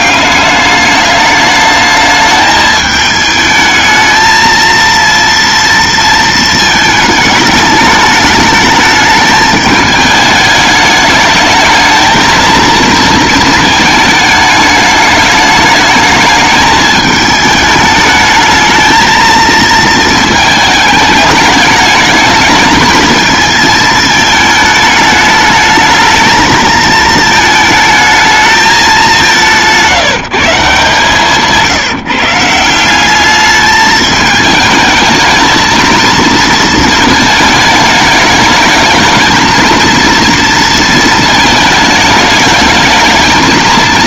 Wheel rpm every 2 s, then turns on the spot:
210, 210, 230, 220, 220, 210, 230, 210, 210, 220, 210, 220, 210, 220, 210, 150, 190, 220, 220, 220, 230, 220.
none